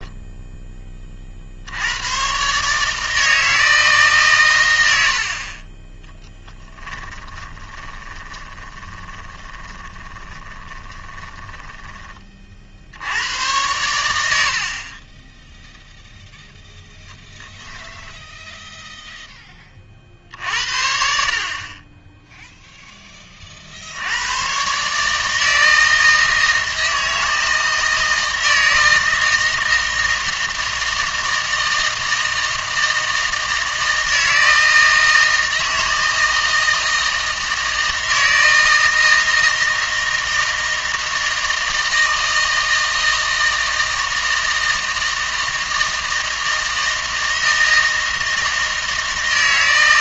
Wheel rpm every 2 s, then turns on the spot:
10, 150, 110, 20, 20, 20, 60, 60, 0, 0, 60, 0, 140, 160, 160, 160, 160, 160, 160, 160, 160, 160, 160, 160, 160.
6-12